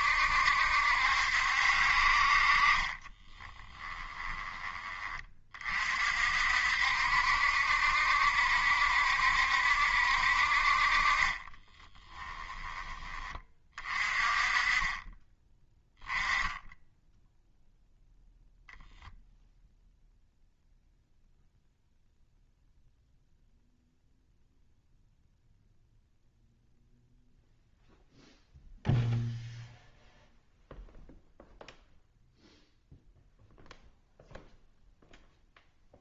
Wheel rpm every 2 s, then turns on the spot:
70, 30, 20, 60, 70, 40, 20, 20, 10, 0, 0, 0, 0, 0, 0, 0, 0, 0.
2-4